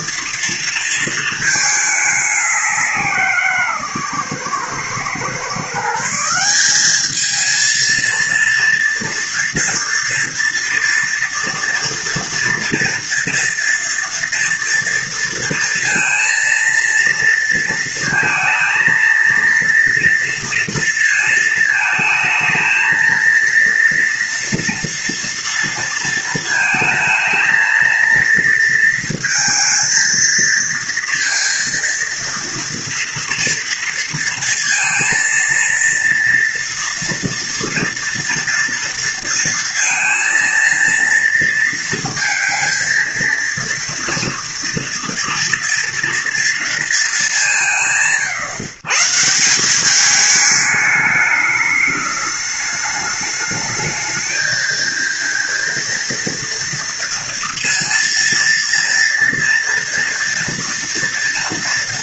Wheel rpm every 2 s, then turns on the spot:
230, 200, 130, 180, 230, 230, 230, 230, 230, 230, 230, 220, 230, 220, 230, 230, 230, 230, 230, 230, 230, 230, 230, 230, 140, 210, 210, 220, 230, 230, 230.
none